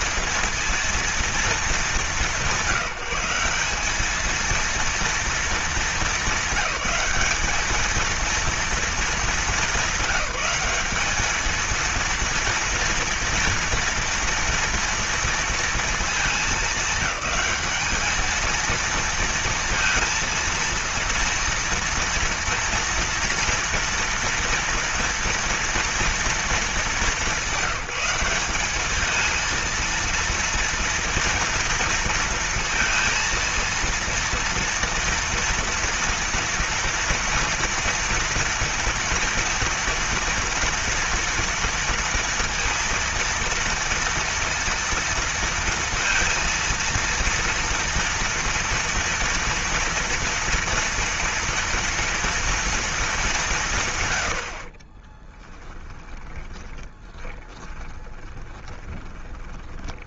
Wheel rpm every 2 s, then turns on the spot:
230, 190, 230, 200, 230, 210, 230, 230, 210, 220, 230, 230, 230, 210, 210, 230, 230, 230, 230, 230, 230, 230, 230, 230, 230, 230, 220, 40, 20, 20.
54-60